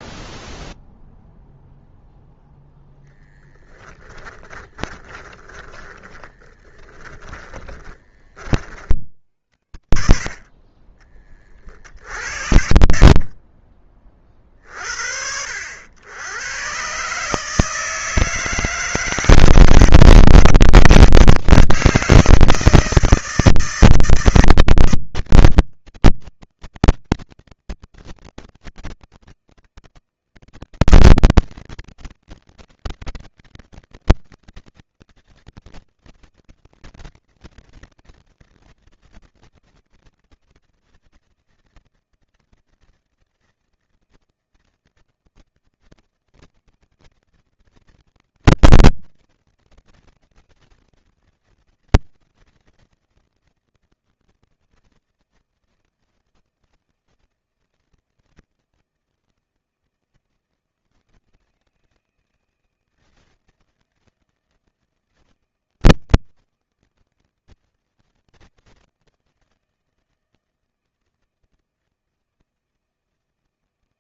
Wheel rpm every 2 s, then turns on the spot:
0, 0, 20, 10, 50, 40, 20, 40, 110, 160, 160, 160, 160, 160, 160, 160, 160, 170, 170, 170, 160, 160, 160, 160, 160, 160, 160, 160, 160, 160, 160, 160, 160, 170, 160, 160, 160.
4-8 10-12